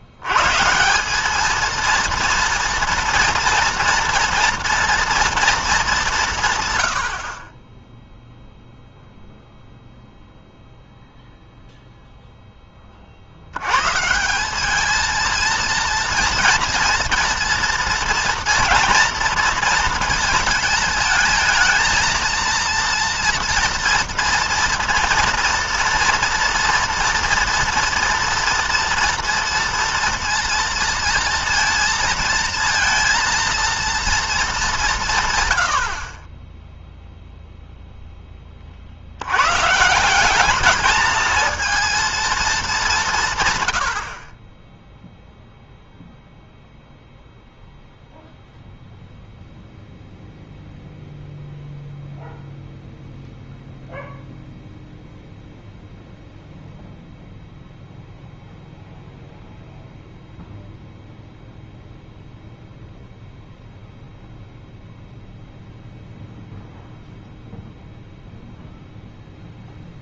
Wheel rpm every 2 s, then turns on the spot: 90, 230, 230, 130, 0, 0, 10, 190, 230, 230, 220, 230, 230, 230, 240, 230, 220, 200, 20, 30, 200, 210, 20, 0, 0, 0, 0, 0, 0, 0, 0, 0, 0, 0, 0.
none